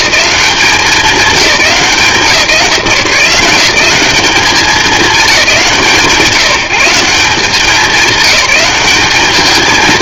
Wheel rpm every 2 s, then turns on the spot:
190, 170, 200, 180, 200.
none